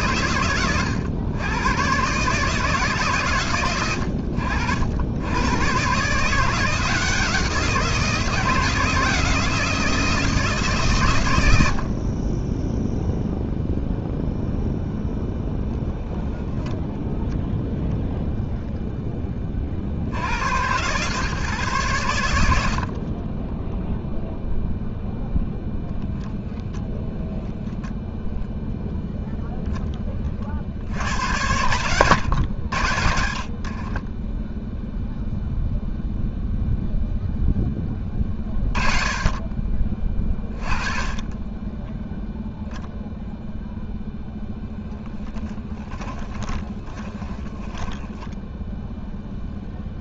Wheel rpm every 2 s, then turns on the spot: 120, 90, 130, 170, 170, 60, 0, 10, 0, 50, 130, 10, 0, 10, 0, 100, 30, 0, 10, 20, 20, 0, 10, 10, 0.
22-24 32-34 44-48